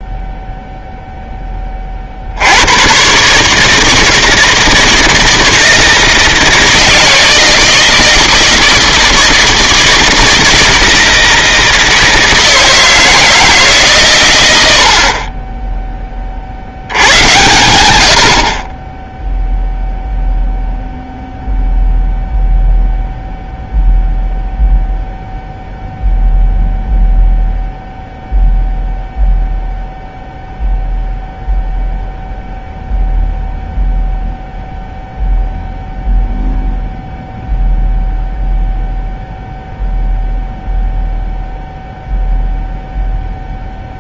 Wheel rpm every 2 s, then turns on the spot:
0, 90, 160, 160, 160, 160, 160, 80, 70, 40, 0, 0, 0, 0, 0, 0, 0, 0, 0, 0, 0, 0.
none